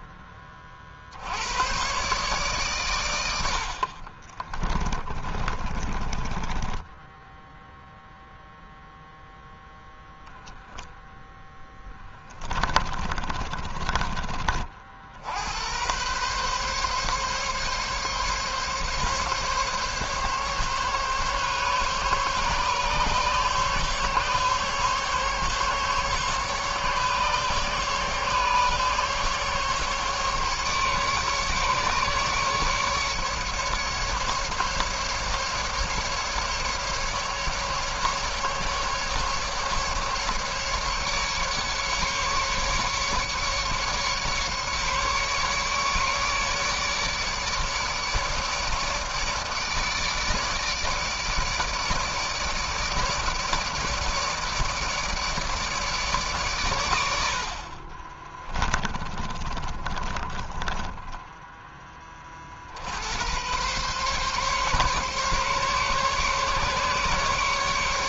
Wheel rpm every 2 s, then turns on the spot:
60, 120, 30, 10, 0, 10, 30, 90, 140, 140, 140, 140, 140, 140, 140, 140, 140, 140, 150, 140, 150, 140, 140, 150, 150, 150, 150, 150, 80, 20, 10, 70, 140, 140.
4-8 10-14 58-62